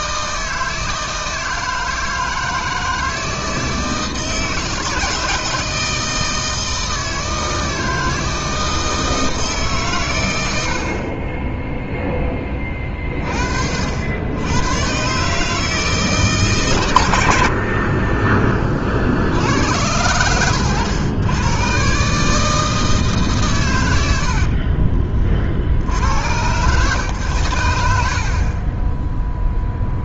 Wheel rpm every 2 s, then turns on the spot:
160, 160, 160, 160, 160, 60, 30, 110, 130, 40, 100, 160, 40, 120, 10.
24-26